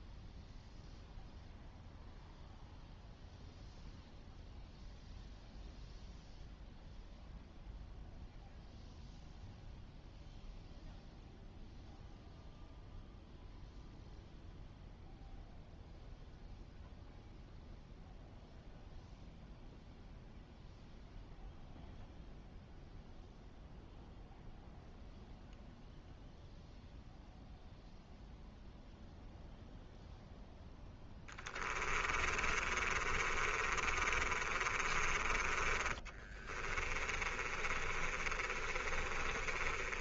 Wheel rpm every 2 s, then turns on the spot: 0, 0, 0, 0, 0, 0, 0, 0, 0, 0, 0, 0, 0, 0, 0, 10, 30, 30, 20, 30.
30-40